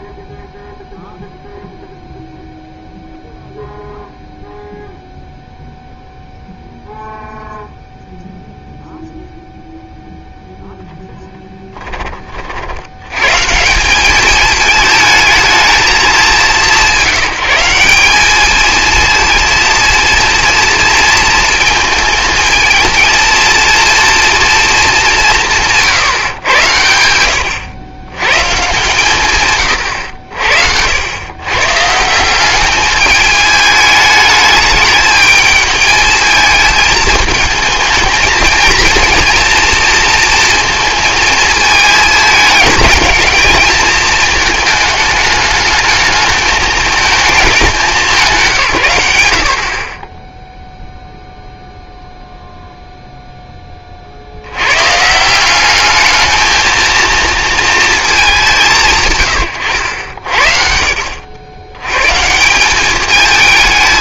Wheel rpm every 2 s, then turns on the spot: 0, 0, 0, 0, 0, 0, 70, 220, 200, 220, 230, 230, 230, 100, 130, 70, 200, 210, 220, 230, 230, 220, 220, 210, 150, 0, 0, 100, 220, 170, 60, 180.
none